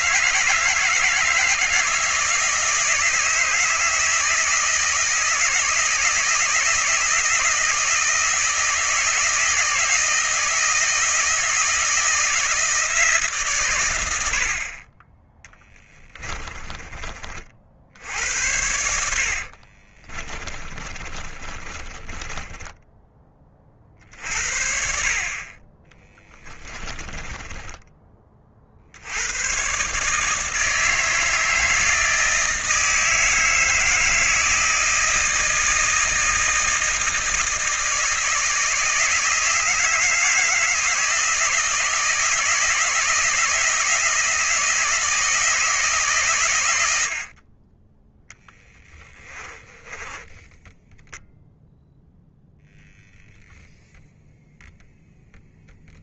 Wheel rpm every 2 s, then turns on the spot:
160, 160, 160, 160, 160, 160, 170, 40, 30, 80, 30, 10, 50, 20, 70, 160, 160, 160, 160, 160, 160, 160, 160, 90, 10, 10, 0, 0.
16-24 26-28 48-50